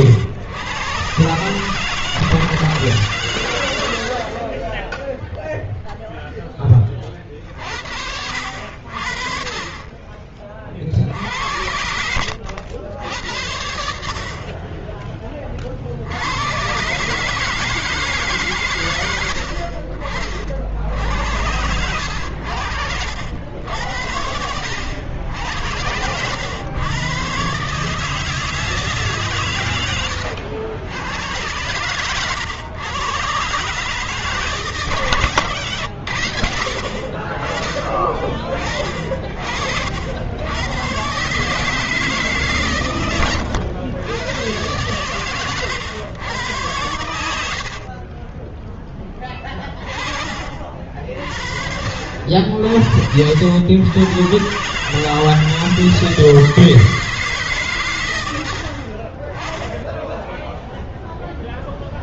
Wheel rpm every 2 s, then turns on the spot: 120, 150, 30, 20, 60, 60, 80, 30, 120, 120, 60, 70, 80, 110, 150, 110, 110, 140, 50, 50, 120, 120, 120, 100, 20, 50, 60, 140, 160, 50, 0.
4-6